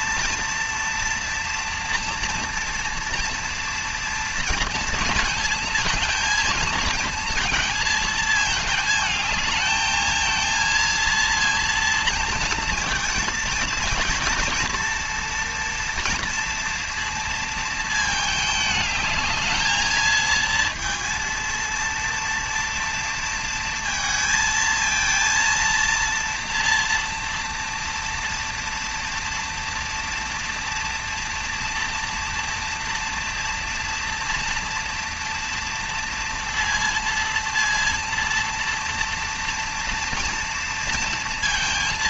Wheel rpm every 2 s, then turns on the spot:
230, 230, 230, 220, 220, 220, 230, 230, 230, 220, 220, 230, 220, 230, 230, 230, 230, 230, 230, 230, 230.
none